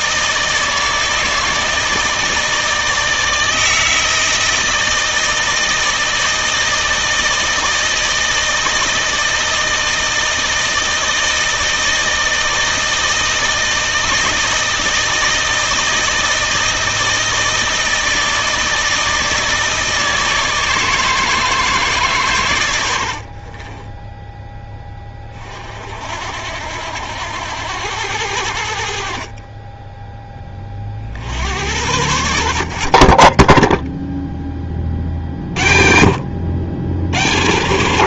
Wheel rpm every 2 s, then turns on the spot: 160, 160, 160, 160, 160, 160, 160, 160, 160, 160, 160, 110, 20, 80, 70, 30, 50, 20, 70.
none